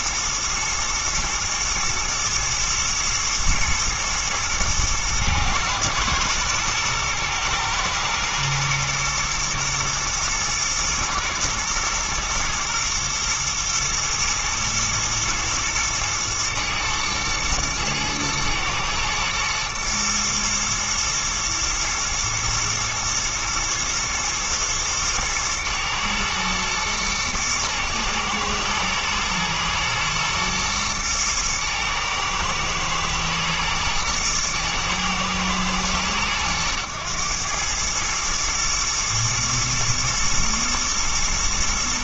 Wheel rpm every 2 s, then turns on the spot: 120, 120, 110, 120, 120, 120, 110, 110, 110, 110, 120, 120, 120, 120, 110, 110, 110, 110, 100, 110, 120.
none